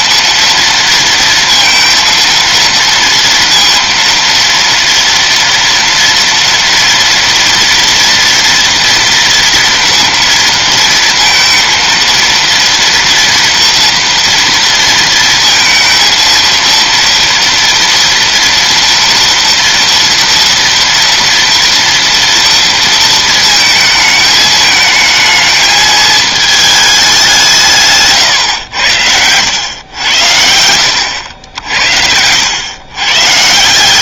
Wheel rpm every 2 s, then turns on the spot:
230, 230, 230, 230, 230, 230, 230, 230, 230, 230, 230, 230, 220, 220, 90, 90, 100.
none